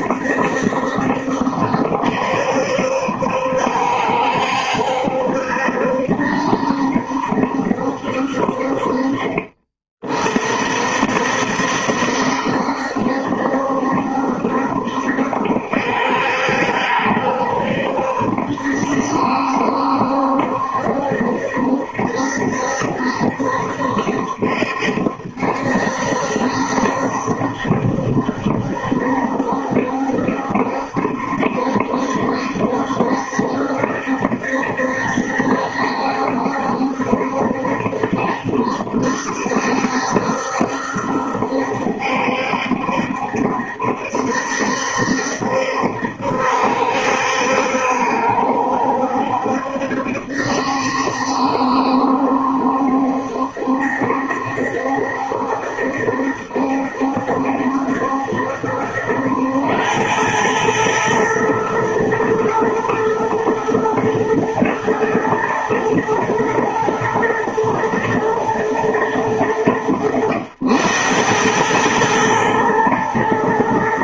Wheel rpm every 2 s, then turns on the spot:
70, 70, 70, 70, 50, 60, 70, 70, 70, 70, 70, 70, 70, 70, 70, 70, 70, 70, 70, 70, 70, 70, 70, 70, 70, 70, 70, 70, 70, 80, 110, 120, 110, 110, 110, 90, 110.
none